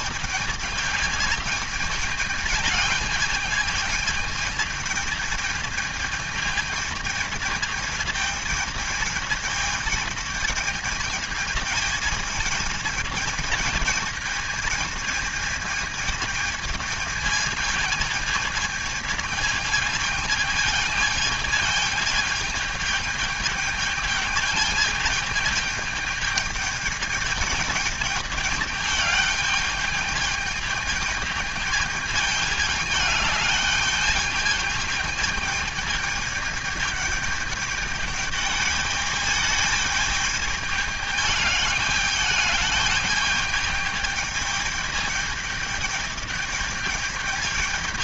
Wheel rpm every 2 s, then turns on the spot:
220, 220, 220, 220, 220, 220, 220, 220, 220, 220, 220, 210, 220, 210, 210, 210, 210, 210, 210, 210, 210, 210, 210, 210.
none